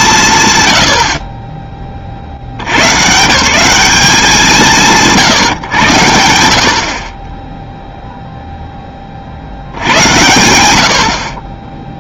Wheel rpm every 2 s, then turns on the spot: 70, 140, 40, 0, 90, 20.
none